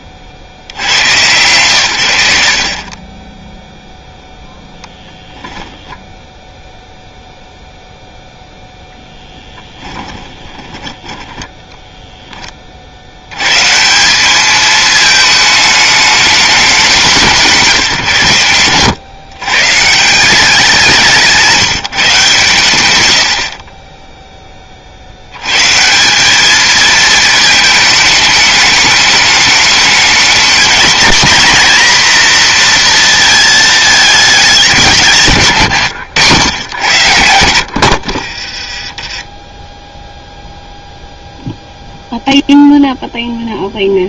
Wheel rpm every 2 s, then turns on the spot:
50, 60, 0, 0, 0, 10, 40, 210, 190, 110, 190, 130, 30, 220, 210, 220, 240, 190, 110, 30, 0, 0.
10-12 38-40